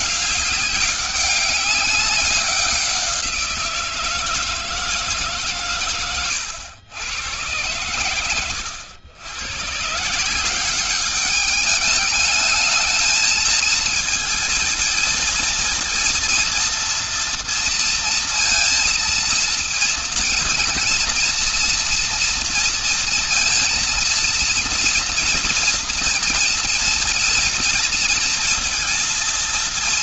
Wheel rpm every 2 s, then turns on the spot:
190, 190, 160, 100, 100, 190, 210, 220, 230, 230, 230, 230, 230, 230, 230.
none